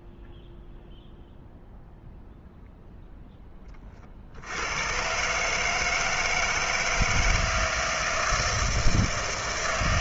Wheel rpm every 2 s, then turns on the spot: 0, 0, 80, 160, 160.
none